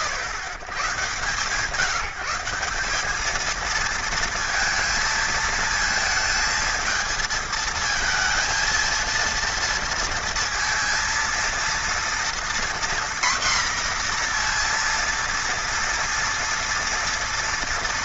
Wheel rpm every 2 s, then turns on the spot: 120, 190, 230, 230, 230, 230, 240, 240, 230.
none